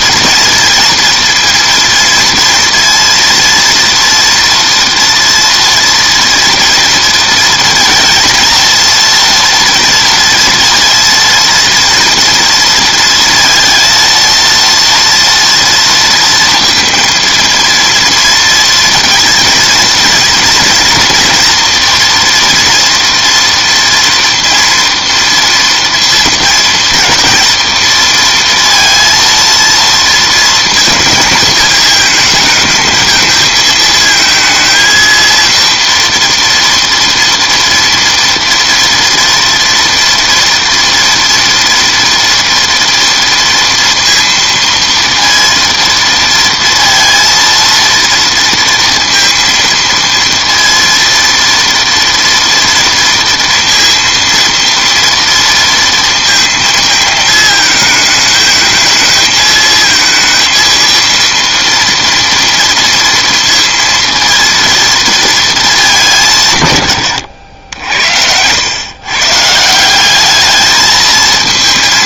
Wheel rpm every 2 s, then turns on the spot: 230, 230, 230, 230, 230, 230, 230, 230, 230, 220, 230, 230, 230, 230, 230, 230, 220, 220, 230, 230, 230, 230, 230, 230, 230, 230, 230, 230, 230, 220, 230, 230, 230, 120, 110, 220.
none